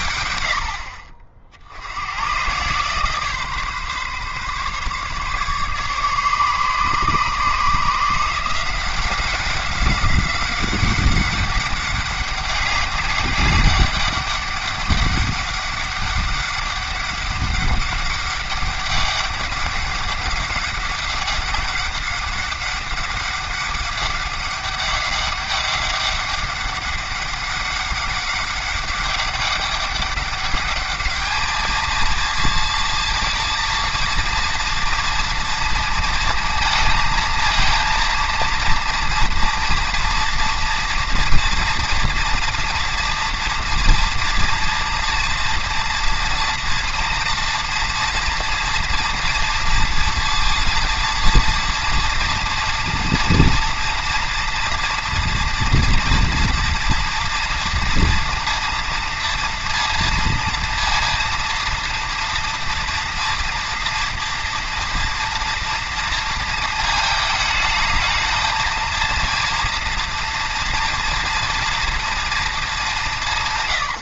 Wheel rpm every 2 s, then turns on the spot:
70, 150, 140, 140, 180, 190, 200, 200, 200, 200, 200, 200, 200, 200, 200, 210, 230, 230, 220, 230, 230, 240, 240, 230, 230, 230, 230, 240, 240, 230, 230, 230, 230, 220, 230, 230, 190.
none